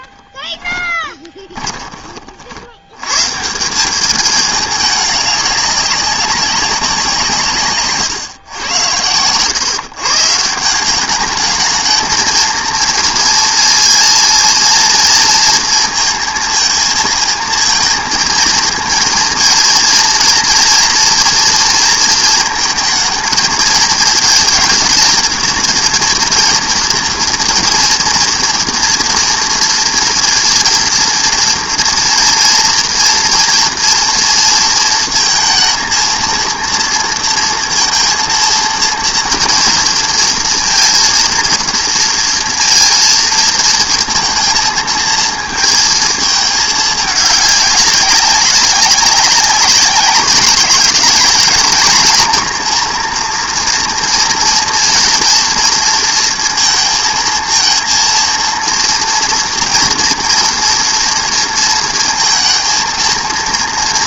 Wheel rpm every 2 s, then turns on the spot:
10, 80, 210, 190, 100, 170, 230, 230, 220, 230, 240, 220, 220, 230, 230, 230, 230, 230, 230, 230, 230, 230, 230, 210, 200, 200, 230, 240, 230, 230, 230, 230.
0-2